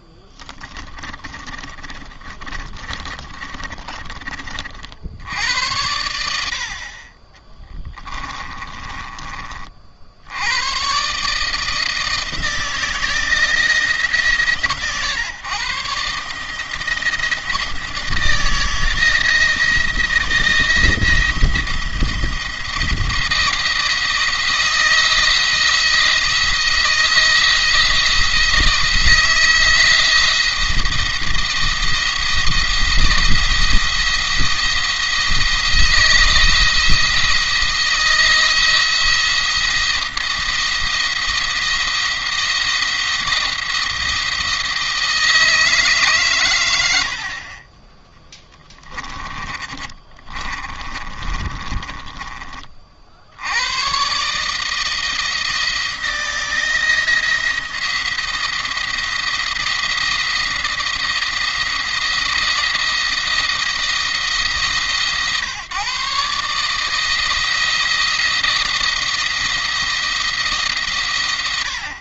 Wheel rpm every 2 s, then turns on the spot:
10, 40, 30, 90, 30, 60, 160, 150, 140, 160, 170, 170, 170, 170, 170, 170, 170, 170, 170, 170, 170, 170, 160, 140, 30, 30, 20, 140, 170, 170, 160, 160, 150, 140, 170, 160.
0-4 8-10 48-52